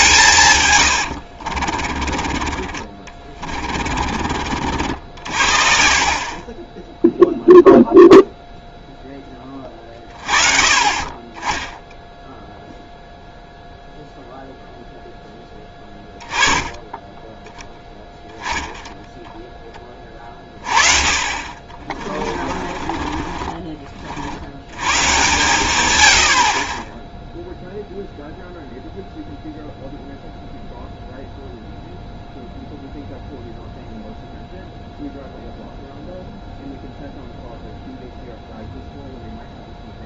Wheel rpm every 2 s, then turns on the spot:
130, 30, 60, 20, 0, 30, 0, 0, 20, 10, 30, 40, 100, 40, 0, 0, 0, 0, 0, 0.
0-4 22-24